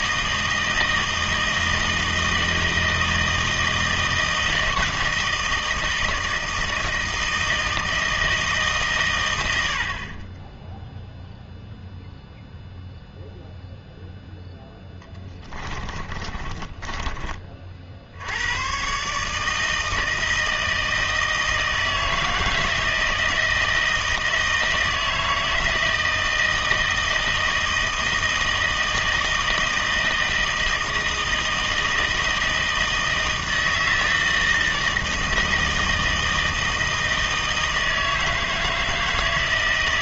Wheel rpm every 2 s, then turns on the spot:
160, 160, 160, 160, 150, 10, 0, 10, 20, 120, 160, 160, 160, 160, 160, 160, 160, 160, 160, 160.
14-18